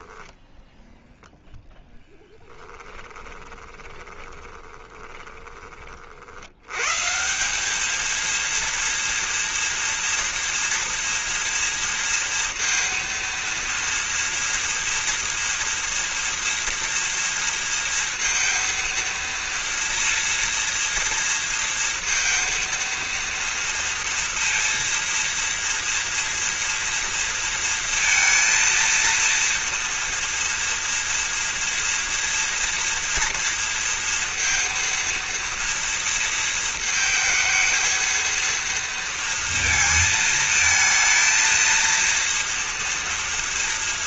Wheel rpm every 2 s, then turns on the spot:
10, 10, 30, 110, 230, 230, 230, 230, 230, 230, 230, 230, 230, 230, 230, 230, 230, 230, 230, 220, 220, 230.
2-6